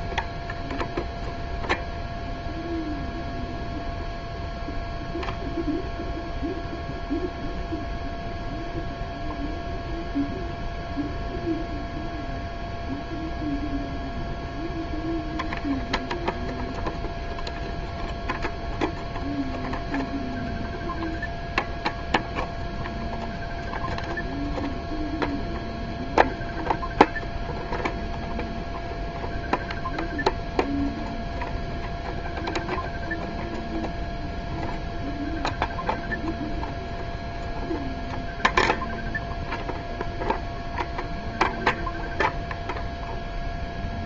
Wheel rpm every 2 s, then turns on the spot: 0, 0, 0, 0, 0, 0, 0, 0, 0, 0, 0, 0, 0, 0, 0, 0, 0, 0, 0, 0, 0, 0.
none